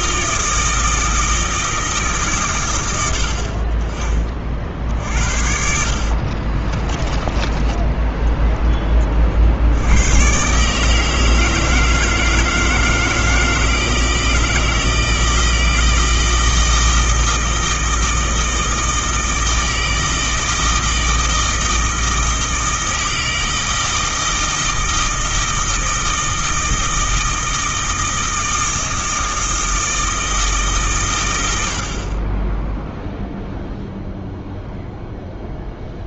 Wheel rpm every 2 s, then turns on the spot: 160, 110, 50, 30, 20, 140, 160, 160, 160, 160, 160, 160, 160, 160, 160, 150, 10, 0.
6-8